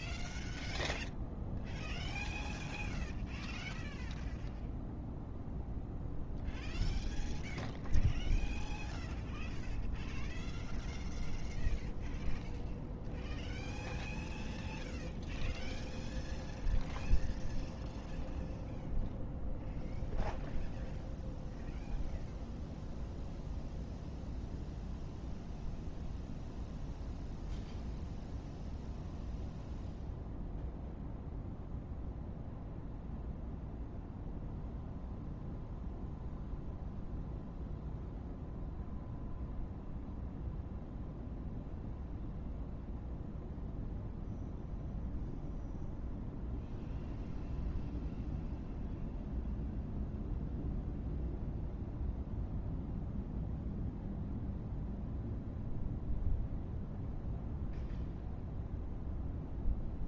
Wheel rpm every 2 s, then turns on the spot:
0, 0, 0, 0, 0, 0, 0, 0, 0, 0, 0, 0, 0, 0, 0, 0, 0, 0, 0, 0, 0, 0, 0, 0, 0, 0, 0, 0, 0, 0.
none